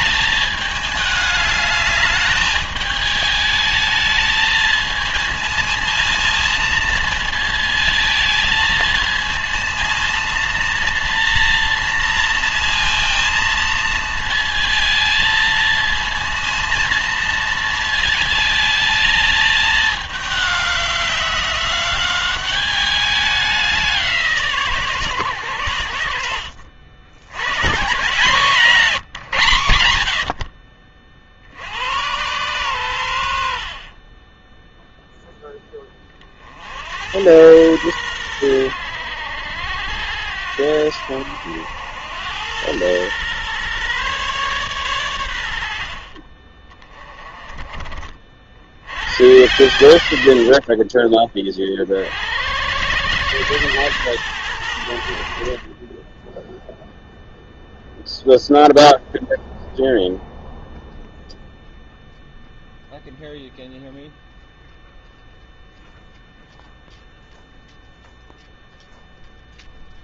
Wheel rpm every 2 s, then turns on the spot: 210, 210, 220, 230, 220, 230, 230, 220, 230, 220, 190, 200, 140, 80, 170, 50, 100, 0, 80, 90, 80, 110, 120, 20, 90, 20, 110, 80, 0, 0, 0, 0, 0, 0, 0.
none